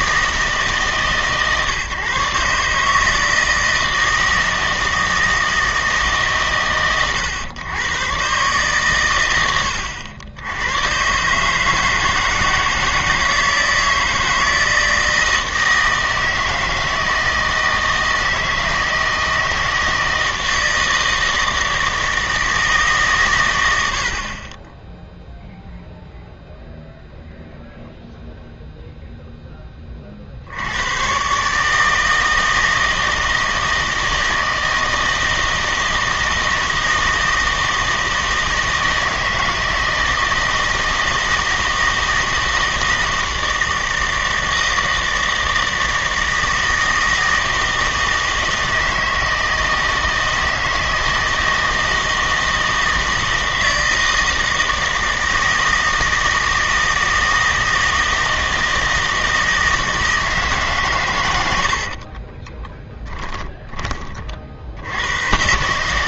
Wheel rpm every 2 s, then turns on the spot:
160, 150, 160, 130, 130, 90, 160, 160, 160, 160, 160, 160, 20, 0, 0, 60, 160, 160, 160, 160, 160, 160, 160, 160, 160, 160, 160, 160, 160, 160, 150, 20, 40.
62-64